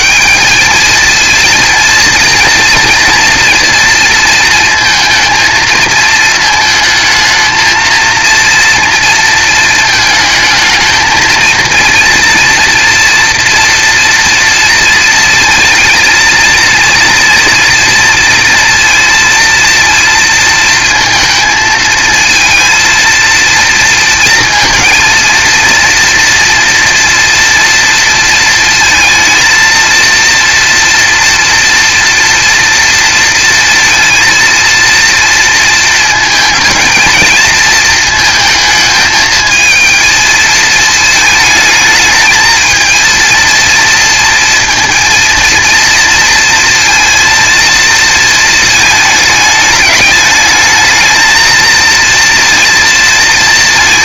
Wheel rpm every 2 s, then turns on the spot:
220, 230, 230, 220, 230, 220, 230, 230, 230, 230, 230, 230, 230, 230, 230, 240, 230, 230, 220, 220, 220, 220, 230, 230, 220, 220, 230.
none